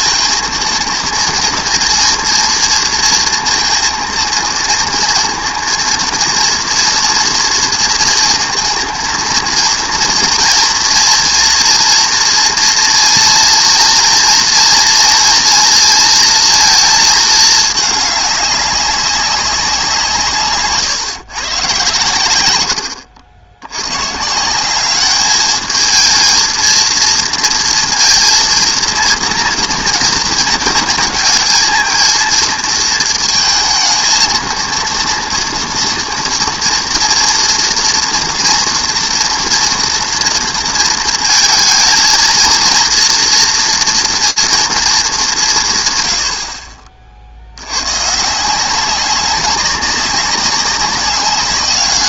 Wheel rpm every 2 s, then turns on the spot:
230, 230, 230, 230, 230, 230, 230, 230, 230, 200, 140, 90, 180, 230, 230, 230, 230, 230, 240, 240, 230, 230, 230, 50, 180, 200.
20-22